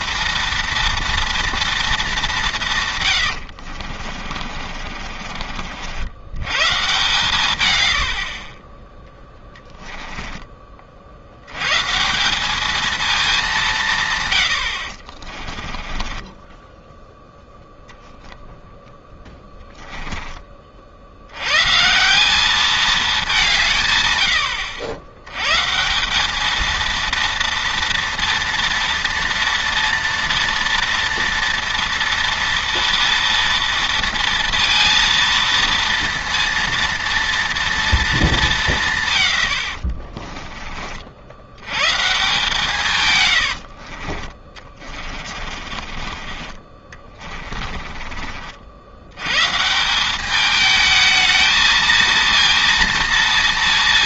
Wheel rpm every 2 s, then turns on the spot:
230, 150, 40, 130, 20, 40, 210, 50, 10, 0, 40, 210, 90, 220, 230, 230, 230, 230, 230, 180, 20, 150, 30, 30, 70, 210, 230.
4-6 14-18 44-48